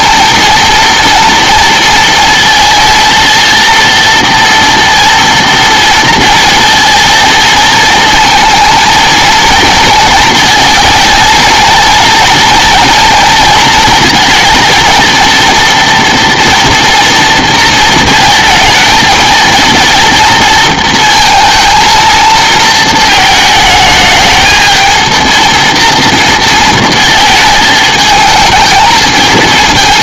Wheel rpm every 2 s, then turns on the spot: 230, 230, 230, 230, 230, 230, 230, 230, 230, 230, 230, 230, 220, 230, 220.
none